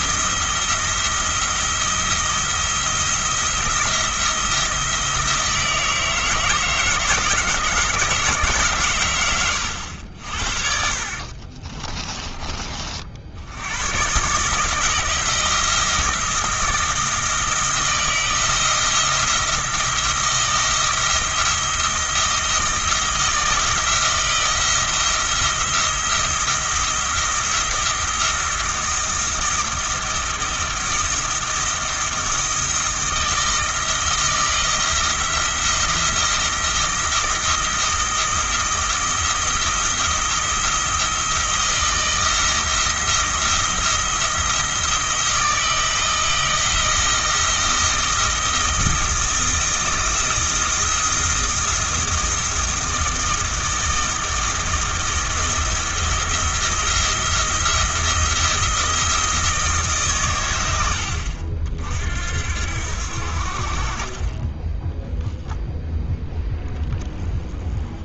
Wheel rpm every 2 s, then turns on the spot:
170, 170, 170, 160, 130, 60, 40, 160, 170, 170, 170, 170, 170, 170, 160, 170, 160, 170, 170, 170, 170, 170, 170, 160, 160, 160, 170, 170, 170, 170, 90, 80, 10, 10.
none